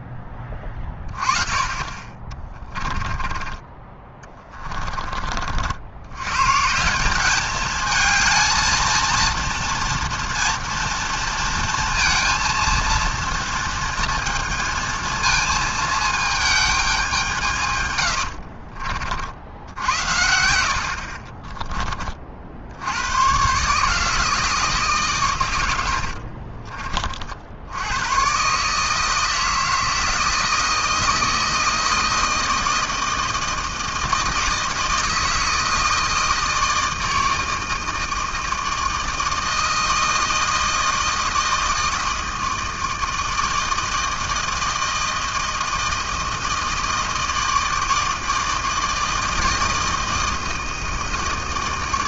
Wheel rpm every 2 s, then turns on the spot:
20, 20, 20, 150, 220, 240, 230, 230, 220, 70, 70, 70, 160, 40, 140, 160, 160, 160, 160, 160, 160, 160, 160, 160, 160, 160.
2-6 18-22 26-28